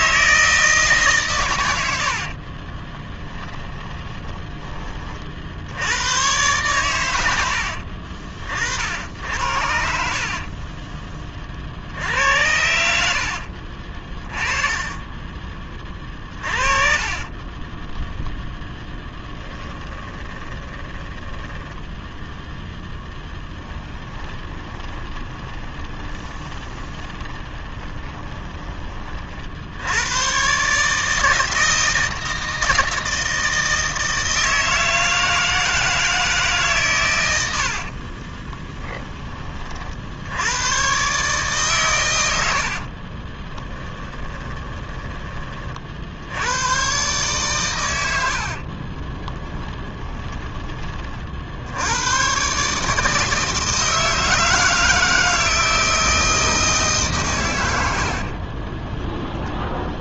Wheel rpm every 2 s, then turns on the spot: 160, 30, 30, 110, 60, 20, 70, 20, 40, 10, 20, 0, 20, 20, 20, 150, 160, 160, 140, 10, 120, 40, 10, 110, 40, 20, 150, 160, 150, 20.
2-4 12-18 20-22 24-28 38-40 42-44 48-50 58-60